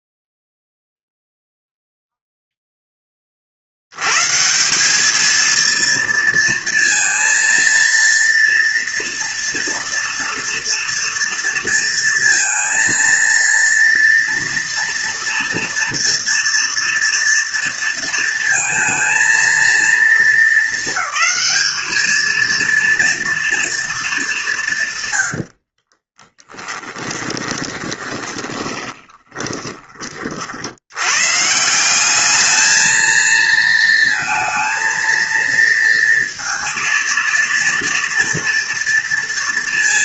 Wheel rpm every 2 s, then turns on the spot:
0, 10, 200, 230, 230, 230, 230, 230, 230, 220, 200, 230, 120, 10, 10, 100, 220, 230, 230, 230.
26-30